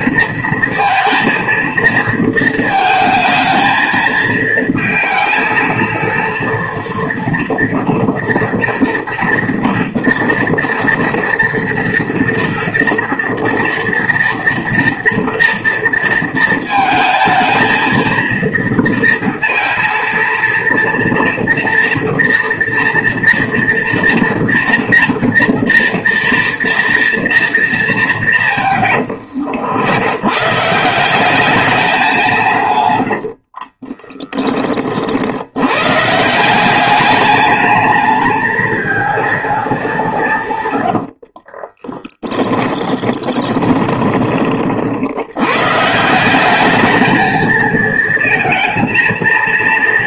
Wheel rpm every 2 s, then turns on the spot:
230, 220, 220, 240, 240, 230, 230, 230, 220, 230, 230, 230, 230, 230, 140, 150, 150, 20, 190, 220, 120, 20, 60, 210, 230.
32-34 40-44